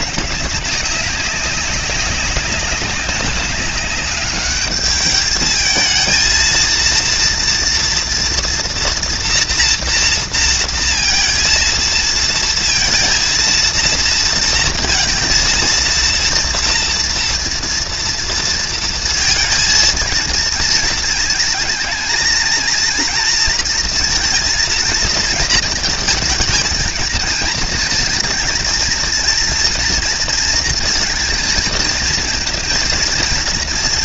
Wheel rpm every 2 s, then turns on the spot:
190, 190, 210, 230, 230, 230, 230, 230, 240, 230, 230, 230, 230, 220, 230, 230, 230.
none